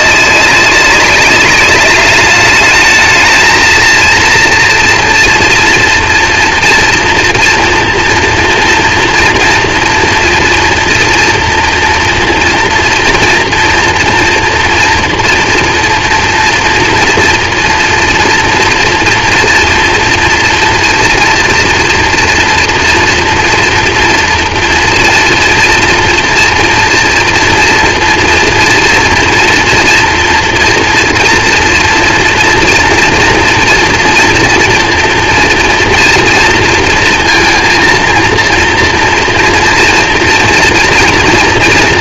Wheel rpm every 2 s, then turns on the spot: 200, 210, 240, 240, 240, 230, 230, 230, 230, 230, 230, 230, 230, 230, 230, 240, 230, 230, 230, 240, 240.
none